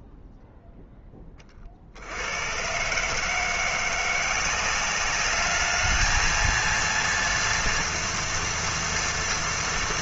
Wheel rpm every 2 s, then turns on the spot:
10, 120, 190, 230, 230.
none